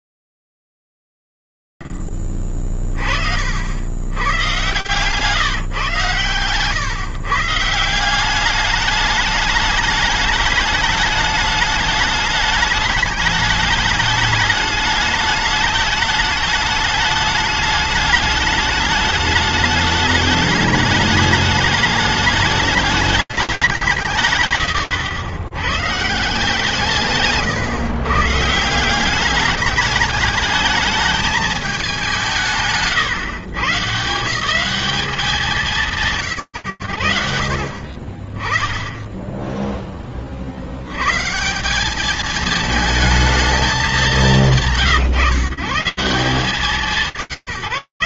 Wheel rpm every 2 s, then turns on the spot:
50, 40, 60, 130, 160, 210, 210, 210, 220, 210, 210, 210, 170, 160, 150, 210, 180, 150, 160, 20, 100, 220, 130, 180.
none